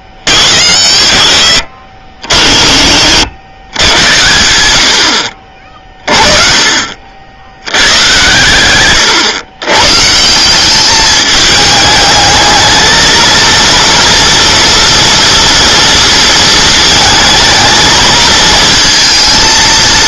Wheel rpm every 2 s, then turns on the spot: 50, 50, 80, 40, 120, 190, 220, 230, 220, 230.
none